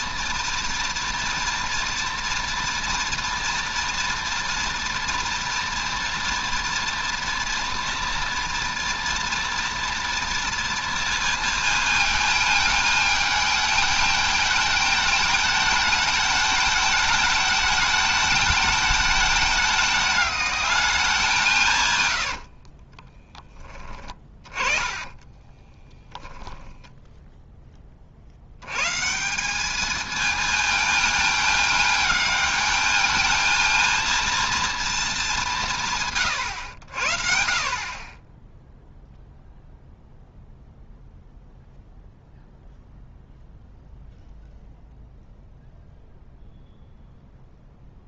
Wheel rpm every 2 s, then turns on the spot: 240, 230, 240, 230, 230, 230, 220, 220, 220, 220, 210, 40, 30, 10, 120, 230, 220, 230, 90, 0, 0, 0, 0, 0.
22-26